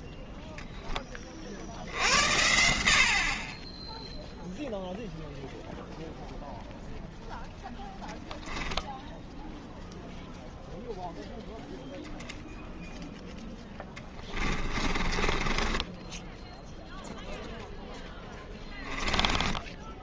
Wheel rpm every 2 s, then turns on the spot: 10, 70, 0, 0, 0, 0, 0, 30, 10, 10.
14-16 18-20